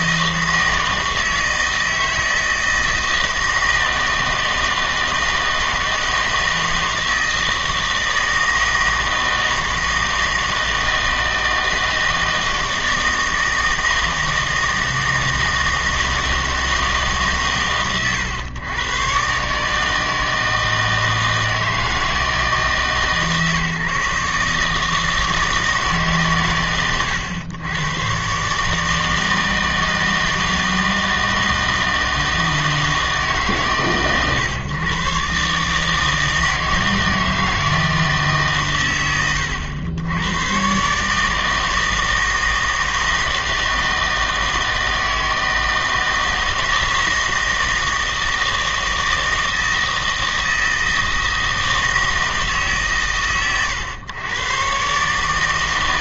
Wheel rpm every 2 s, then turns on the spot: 160, 160, 160, 160, 160, 160, 160, 160, 160, 110, 160, 160, 150, 120, 150, 160, 160, 120, 160, 130, 120, 160, 160, 160, 160, 160, 150, 130.
none